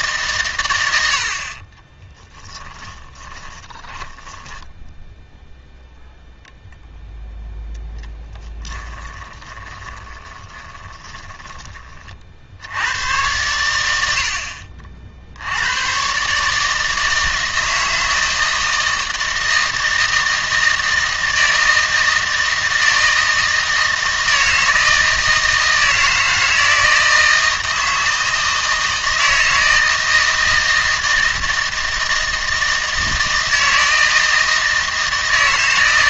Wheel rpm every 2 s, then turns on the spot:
110, 10, 10, 0, 20, 20, 60, 60, 150, 160, 160, 160, 160, 160, 160, 160, 160, 160.
2-6 8-12